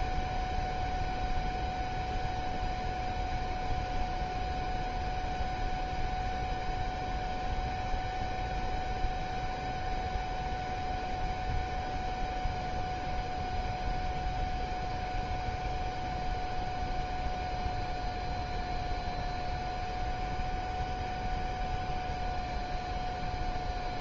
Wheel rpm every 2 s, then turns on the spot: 0, 0, 0, 0, 0, 0, 0, 0, 0, 0, 0, 0.
none